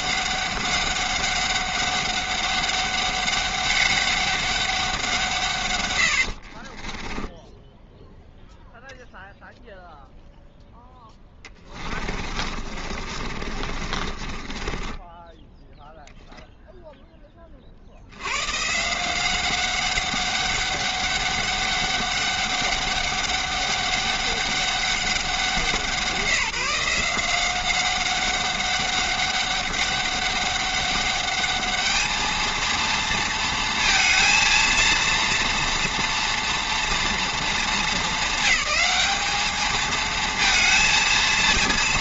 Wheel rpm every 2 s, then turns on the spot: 200, 200, 200, 50, 0, 0, 30, 30, 0, 130, 200, 200, 200, 170, 200, 200, 230, 230, 230, 200, 230.
6-8 12-16